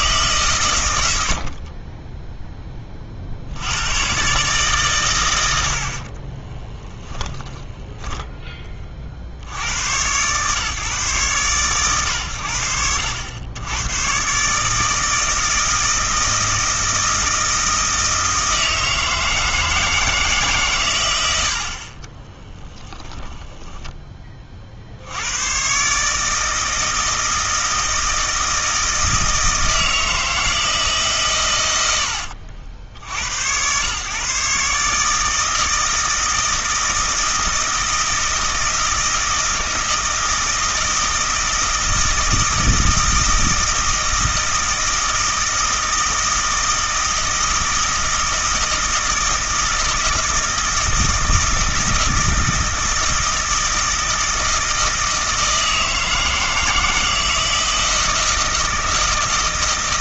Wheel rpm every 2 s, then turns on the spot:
120, 10, 140, 10, 10, 130, 80, 150, 160, 160, 120, 20, 40, 160, 160, 160, 70, 140, 160, 160, 160, 160, 160, 160, 160, 160, 160, 160, 160, 160.
6-8 22-24